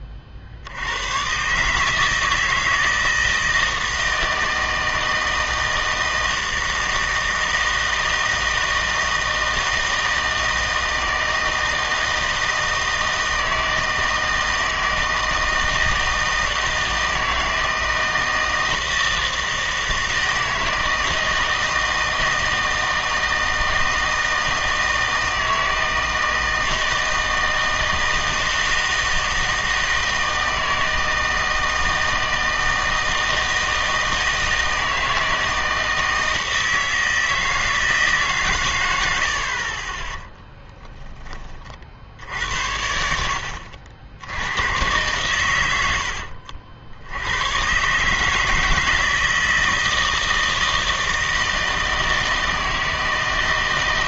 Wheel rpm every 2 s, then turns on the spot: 60, 160, 160, 160, 160, 160, 160, 160, 160, 160, 160, 160, 160, 160, 160, 160, 160, 160, 160, 120, 10, 70, 100, 60, 160, 160, 160.
none